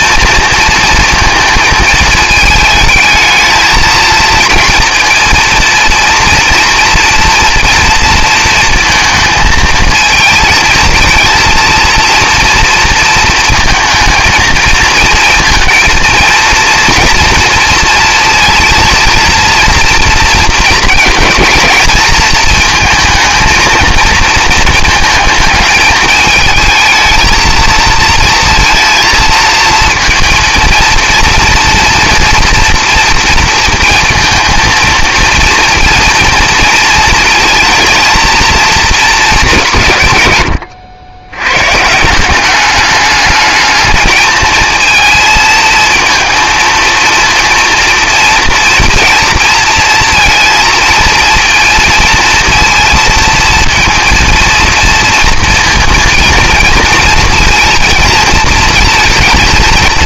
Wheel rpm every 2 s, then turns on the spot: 230, 220, 230, 230, 230, 220, 230, 220, 230, 230, 230, 220, 220, 220, 230, 230, 240, 230, 230, 230, 100, 200, 220, 230, 230, 230, 230, 230, 230, 230.
none